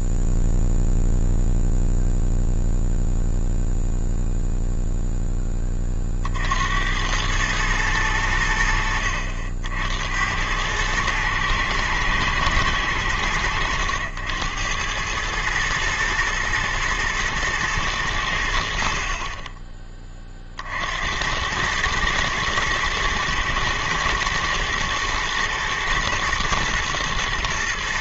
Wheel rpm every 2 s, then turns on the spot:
0, 0, 0, 40, 100, 80, 110, 90, 110, 90, 30, 110, 110, 120.
none